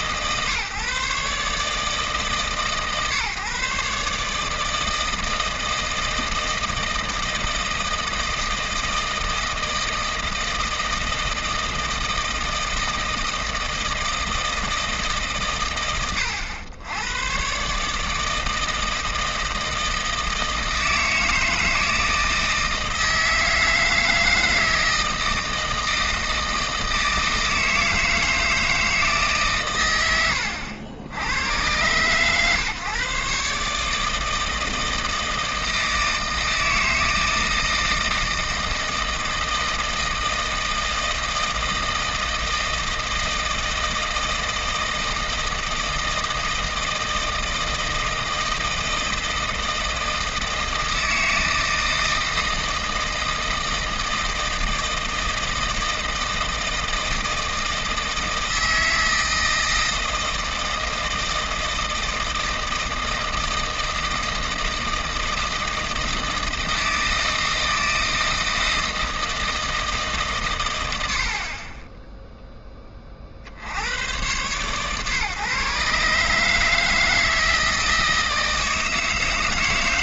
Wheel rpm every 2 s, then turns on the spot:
140, 130, 160, 160, 160, 160, 160, 160, 100, 160, 160, 160, 160, 160, 160, 90, 140, 160, 160, 160, 160, 160, 160, 160, 160, 160, 160, 160, 160, 160, 160, 160, 160, 160, 160, 120, 10, 120, 160, 160.
none